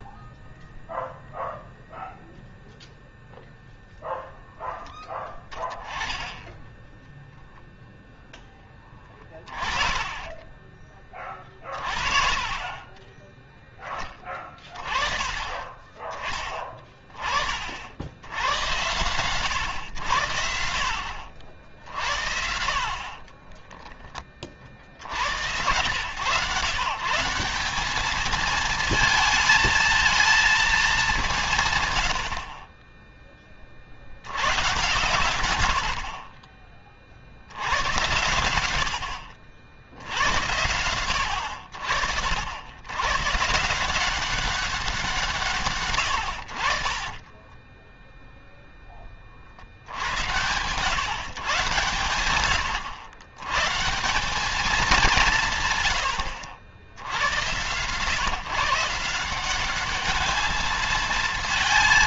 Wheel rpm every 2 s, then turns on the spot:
0, 0, 10, 0, 20, 30, 20, 20, 20, 100, 60, 40, 60, 140, 220, 200, 20, 120, 40, 70, 80, 100, 180, 40, 20, 130, 100, 200, 80, 160, 220.
8-14 22-24 32-34 46-48